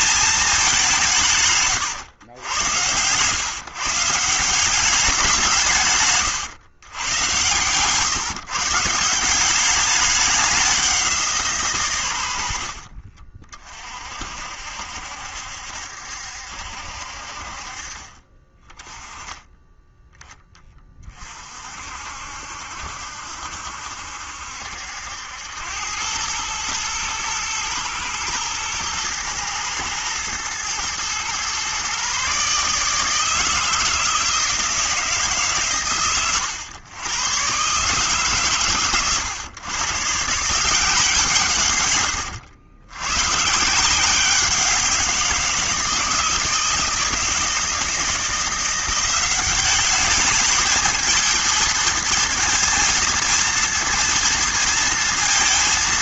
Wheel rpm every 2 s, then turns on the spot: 190, 100, 180, 130, 150, 190, 50, 70, 60, 30, 20, 60, 70, 110, 110, 110, 150, 160, 110, 120, 170, 100, 180, 160, 180, 220, 220, 230.
none